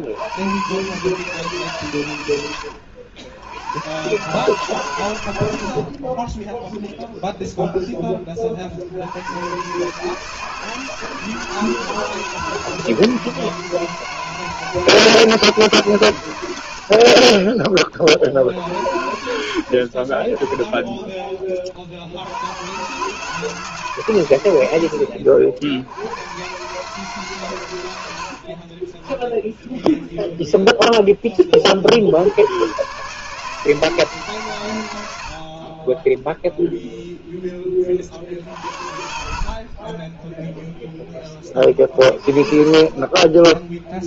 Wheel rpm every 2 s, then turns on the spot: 120, 90, 130, 0, 50, 160, 160, 160, 70, 60, 10, 110, 90, 130, 40, 0, 120, 100, 0, 60, 0, 30.
16-18 28-30 38-40 42-44